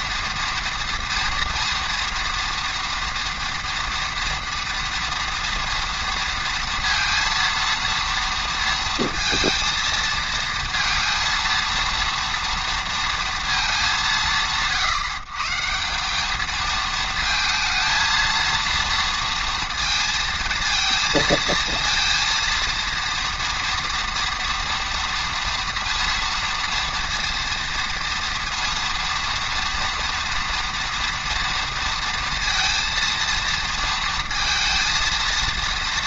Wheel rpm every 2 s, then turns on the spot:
230, 230, 230, 230, 230, 230, 230, 150, 220, 230, 230, 230, 230, 230, 230, 230, 230, 230.
none